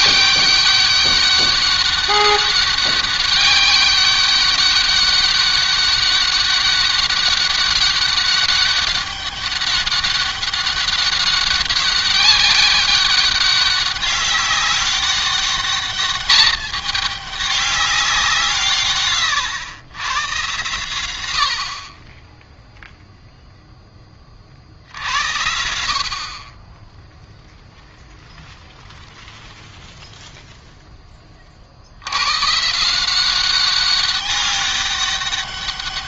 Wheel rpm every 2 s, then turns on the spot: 200, 200, 200, 200, 200, 200, 200, 200, 210, 150, 110, 0, 50, 10, 0, 10, 150, 200.
none